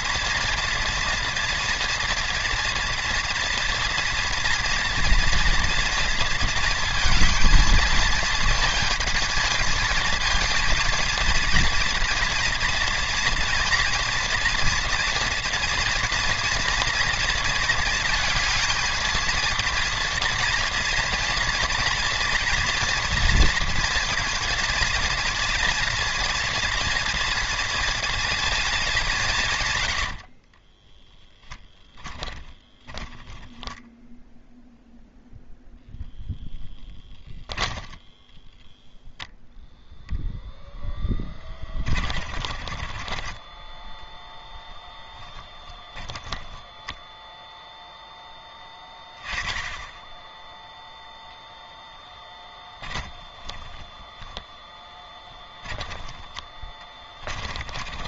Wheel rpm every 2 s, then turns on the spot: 230, 230, 230, 230, 220, 230, 230, 230, 230, 220, 230, 230, 230, 230, 210, 20, 10, 0, 10, 0, 0, 30, 10, 10, 10, 0, 20, 10, 20.
30-34 42-44 52-58